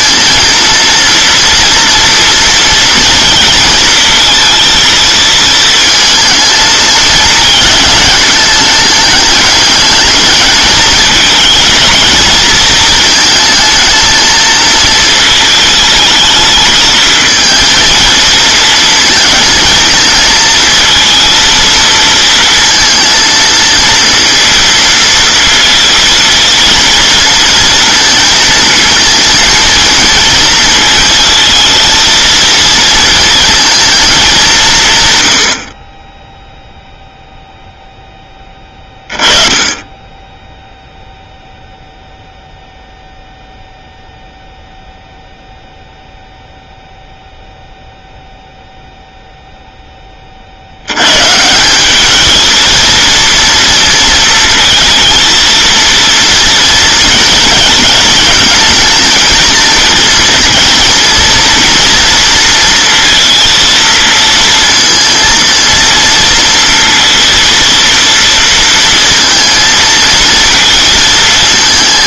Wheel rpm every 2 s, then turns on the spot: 230, 230, 230, 220, 210, 210, 220, 220, 220, 220, 220, 230, 230, 230, 230, 220, 230, 200, 0, 20, 0, 0, 0, 0, 0, 70, 230, 230, 240, 220, 240, 230, 230, 230, 230, 230.
none